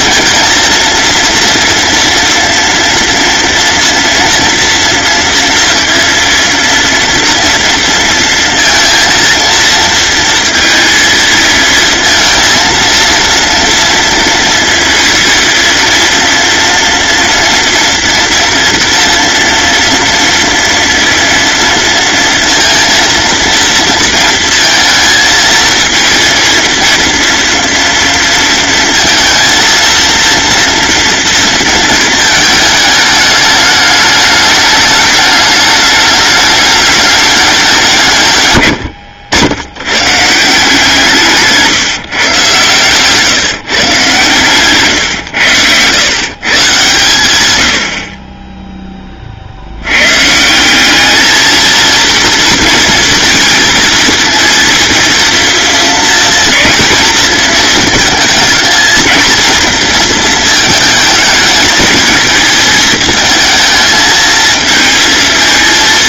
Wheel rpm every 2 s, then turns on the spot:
230, 230, 230, 230, 230, 230, 230, 230, 230, 230, 230, 230, 230, 230, 230, 230, 210, 210, 210, 100, 160, 120, 130, 130, 10, 190, 230, 230, 230, 220, 220, 220, 220.
38-40 42-44